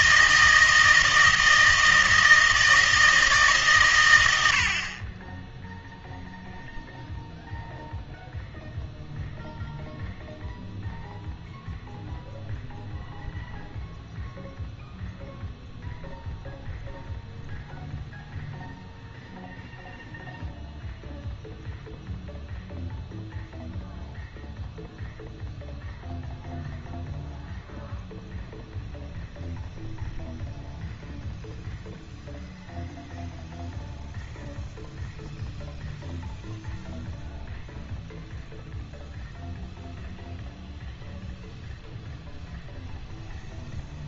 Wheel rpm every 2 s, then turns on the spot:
160, 160, 70, 0, 0, 0, 0, 0, 0, 0, 0, 0, 0, 0, 0, 0, 0, 0, 0, 0, 0, 0.
none